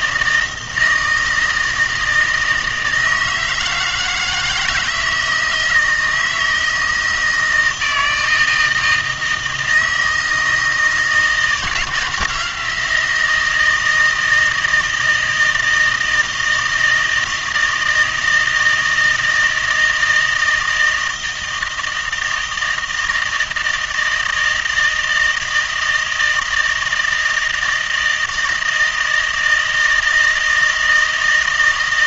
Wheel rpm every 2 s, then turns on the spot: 160, 160, 160, 160, 160, 160, 170, 160, 160, 160, 160, 160, 160, 160, 160, 160.
none